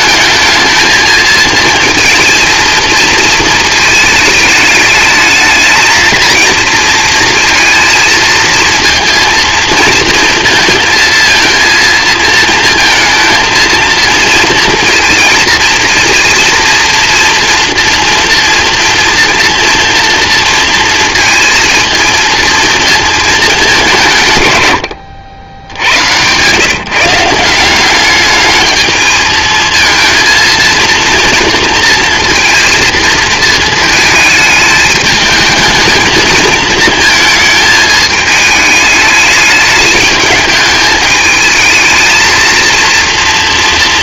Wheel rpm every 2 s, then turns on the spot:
220, 230, 210, 230, 230, 230, 230, 230, 230, 240, 230, 230, 120, 140, 210, 230, 230, 220, 220, 210, 220, 230.
none